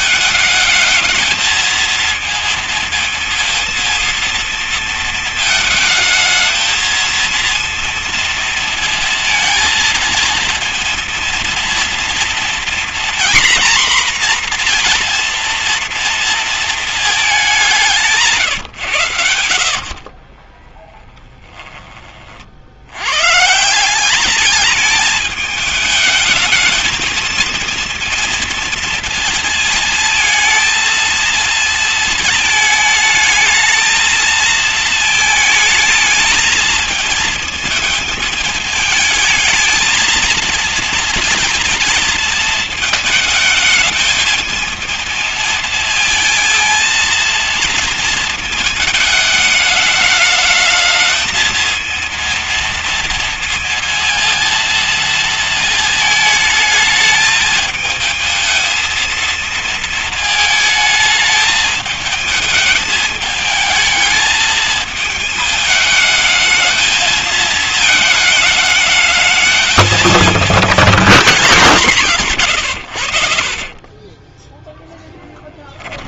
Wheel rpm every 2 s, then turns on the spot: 220, 230, 220, 220, 230, 230, 240, 240, 220, 130, 30, 70, 210, 220, 230, 230, 220, 220, 220, 220, 230, 220, 220, 230, 220, 220, 230, 230, 220, 220, 210, 210, 220, 220, 210, 230, 110, 0.
20-22